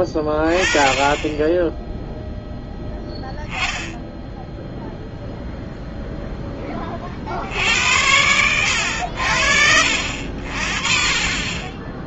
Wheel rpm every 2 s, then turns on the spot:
20, 0, 0, 10, 100, 50.
none